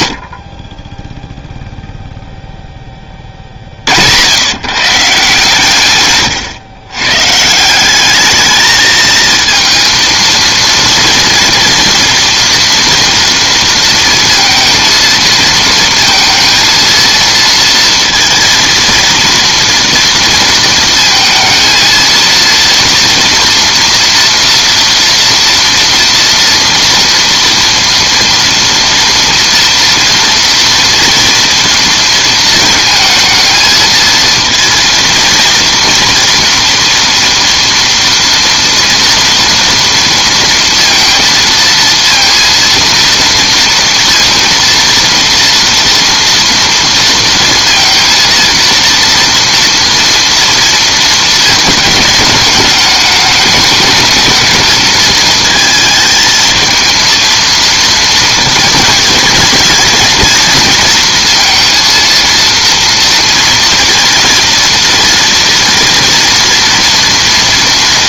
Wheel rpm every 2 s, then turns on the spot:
30, 20, 150, 120, 220, 230, 230, 220, 230, 230, 230, 230, 230, 230, 230, 230, 230, 230, 230, 230, 230, 230, 230, 230, 240, 220, 210, 220, 230, 230, 230, 230, 230, 240.
none